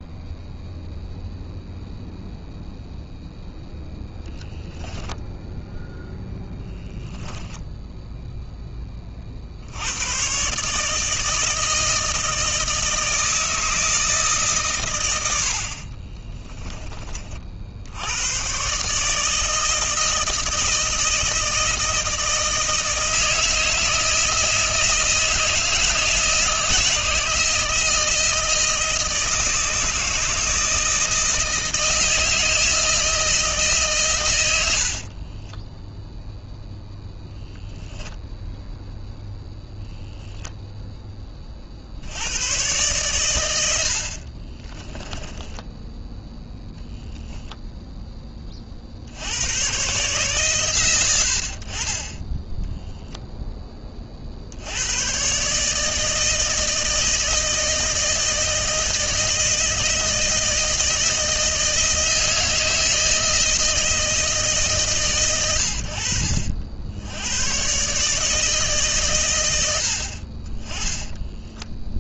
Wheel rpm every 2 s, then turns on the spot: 0, 0, 0, 0, 10, 130, 160, 130, 20, 120, 160, 160, 160, 160, 160, 160, 160, 80, 0, 0, 0, 110, 30, 0, 30, 90, 10, 80, 160, 160, 160, 160, 150, 70, 150, 20.
44-46 52-54